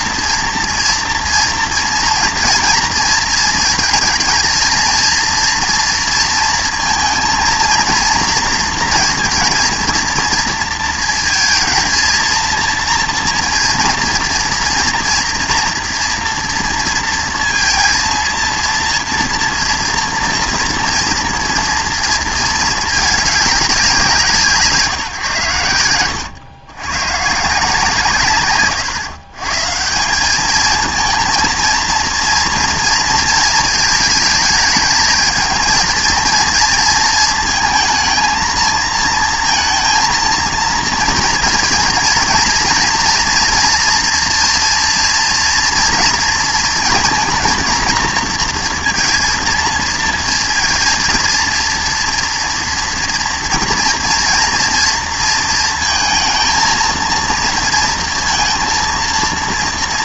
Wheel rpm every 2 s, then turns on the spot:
230, 230, 220, 230, 230, 230, 230, 230, 230, 230, 230, 230, 150, 110, 130, 210, 230, 210, 220, 220, 230, 230, 230, 230, 230, 230, 230, 230, 230, 230.
none